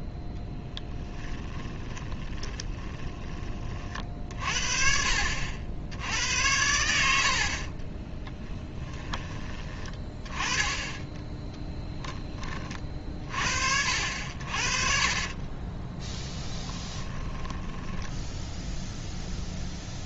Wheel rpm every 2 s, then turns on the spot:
0, 20, 50, 80, 10, 10, 30, 40, 20, 0.
2-4 8-10 16-18